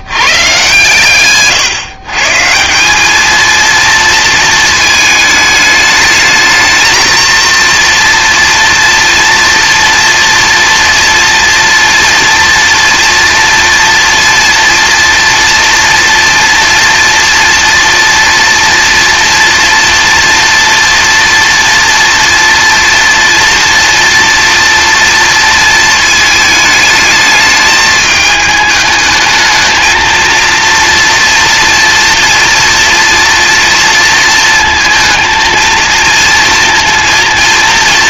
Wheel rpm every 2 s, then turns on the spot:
130, 170, 220, 220, 230, 230, 230, 230, 230, 230, 230, 230, 230, 220, 210, 230, 230, 230, 230.
none